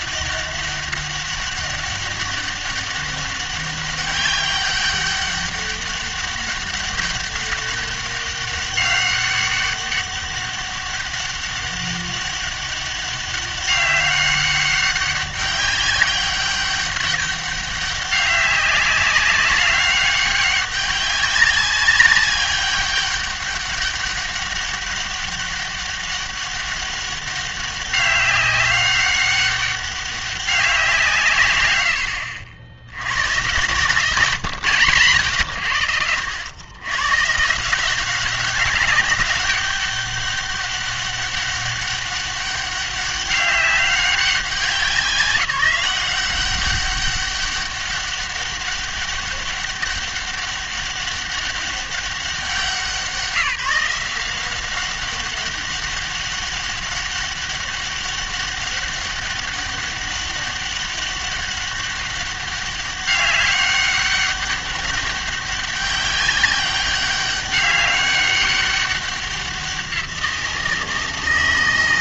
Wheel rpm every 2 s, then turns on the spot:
200, 200, 200, 200, 200, 200, 200, 200, 200, 190, 200, 200, 200, 200, 200, 190, 80, 140, 100, 200, 200, 200, 180, 190, 200, 200, 180, 190, 200, 200, 200, 200, 200, 200, 200, 170.
none